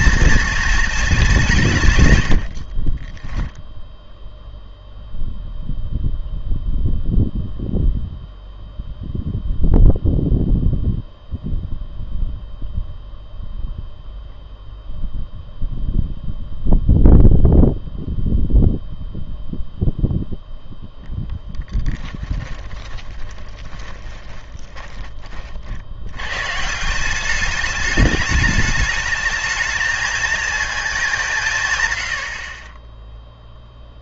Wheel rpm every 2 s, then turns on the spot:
230, 50, 0, 0, 0, 0, 0, 0, 0, 0, 0, 20, 10, 150, 210, 220, 40.
2-4 22-26